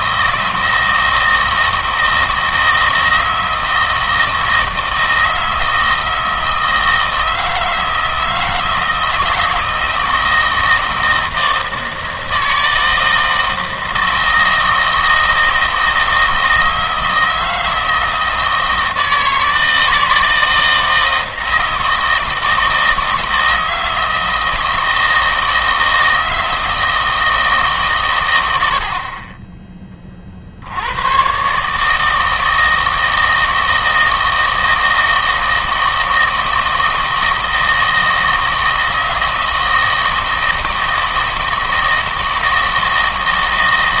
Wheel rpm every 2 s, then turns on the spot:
160, 160, 160, 160, 160, 160, 160, 160, 160, 160, 160, 160, 160, 160, 70, 70, 160, 160, 160, 160, 160, 160.
none